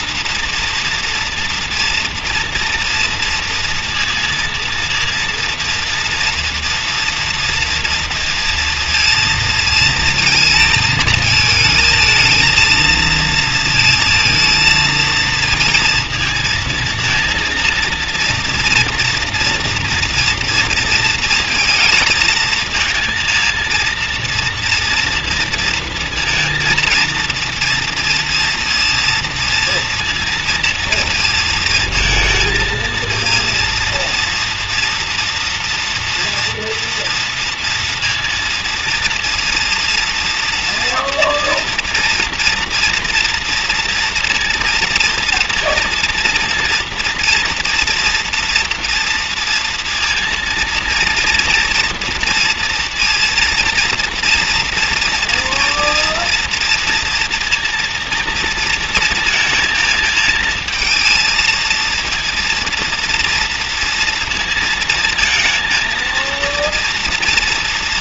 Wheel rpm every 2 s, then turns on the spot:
230, 230, 230, 230, 230, 230, 230, 230, 220, 230, 230, 220, 230, 230, 230, 230, 220, 230, 230, 230, 230, 230, 230, 230, 230, 230, 230, 230, 230, 230, 220, 230, 230, 230.
none